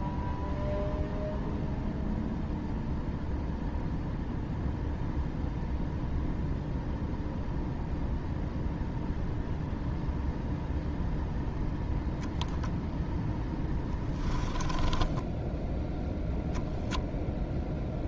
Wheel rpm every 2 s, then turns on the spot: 0, 0, 0, 0, 0, 0, 0, 20, 0.
14-16